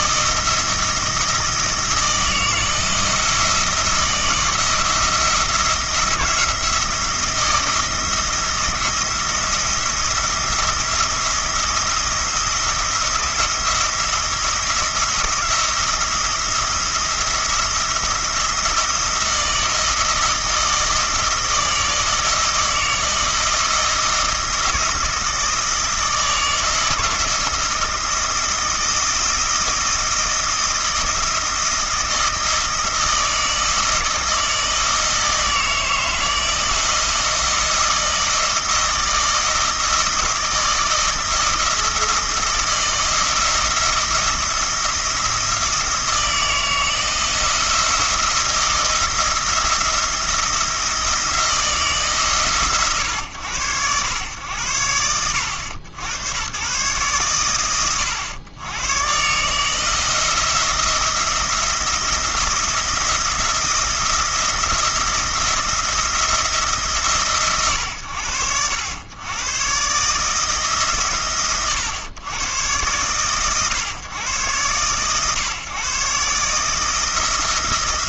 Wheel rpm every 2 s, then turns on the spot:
160, 160, 170, 170, 170, 170, 170, 170, 170, 170, 160, 160, 170, 160, 160, 160, 160, 160, 160, 160, 160, 160, 170, 160, 170, 170, 120, 90, 110, 120, 170, 170, 170, 150, 90, 130, 110, 120, 160.
none